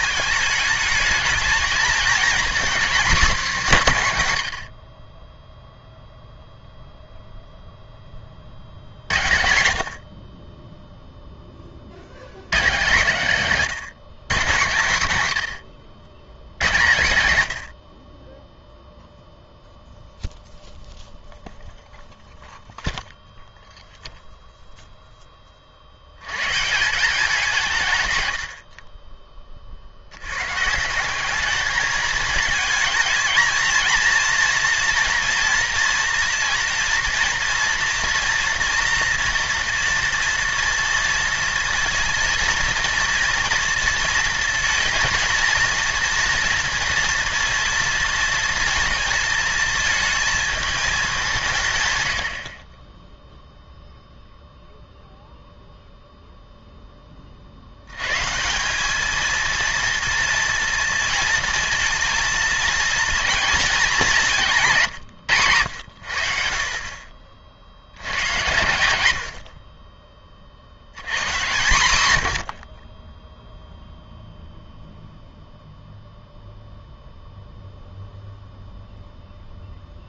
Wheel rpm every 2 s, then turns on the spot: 210, 240, 110, 0, 70, 20, 160, 160, 130, 0, 0, 0, 0, 150, 50, 130, 220, 230, 230, 230, 230, 230, 230, 230, 230, 220, 50, 0, 10, 180, 230, 230, 150, 70, 90, 80, 60, 0, 0, 0.
none